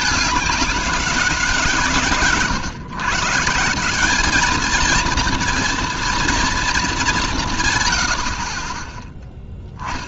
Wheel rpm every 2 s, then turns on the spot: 200, 140, 210, 230, 60.
none